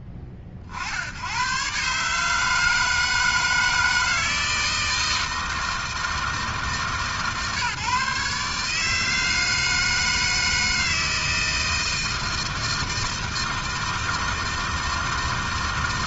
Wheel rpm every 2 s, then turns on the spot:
70, 160, 160, 160, 150, 160, 160, 160.
none